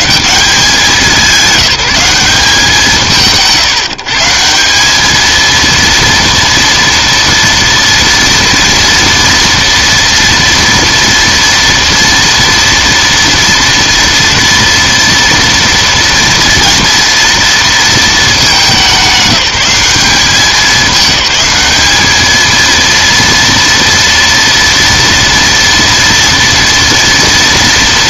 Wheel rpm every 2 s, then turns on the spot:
200, 170, 180, 230, 230, 230, 230, 230, 230, 210, 200, 220, 230, 230.
none